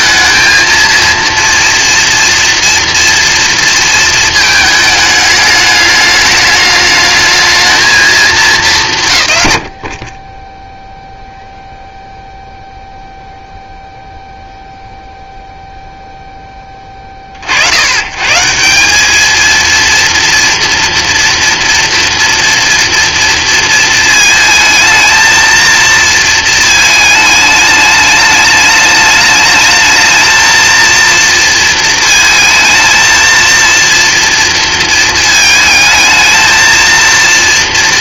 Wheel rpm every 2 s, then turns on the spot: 230, 230, 220, 210, 170, 0, 0, 0, 30, 190, 230, 230, 220, 220, 210, 230, 220, 220, 230.
none